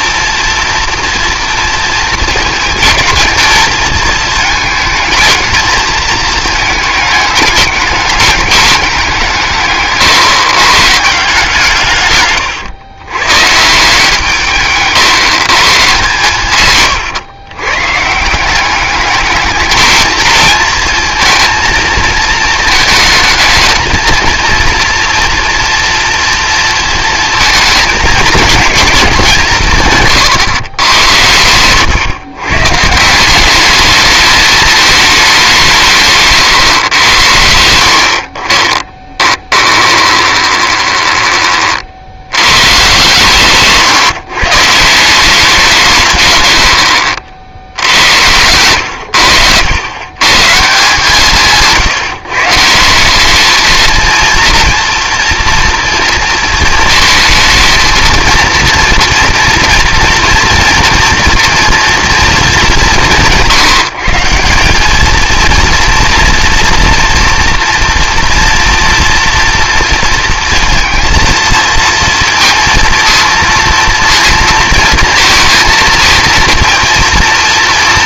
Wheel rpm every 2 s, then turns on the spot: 230, 230, 220, 220, 210, 140, 130, 160, 130, 190, 230, 220, 230, 230, 220, 130, 140, 220, 130, 30, 20, 110, 150, 80, 90, 140, 150, 230, 230, 230, 230, 220, 190, 230, 230, 230, 230, 230, 230.
14-16 36-38 40-42